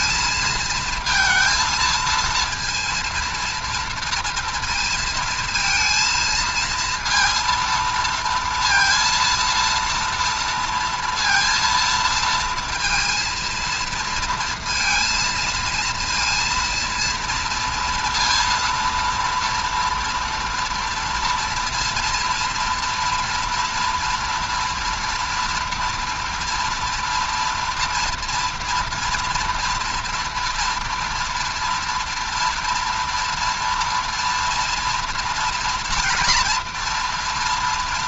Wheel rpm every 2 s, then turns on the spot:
230, 230, 230, 230, 230, 230, 230, 230, 230, 230, 230, 230, 230, 230, 230, 230, 230, 230, 240.
none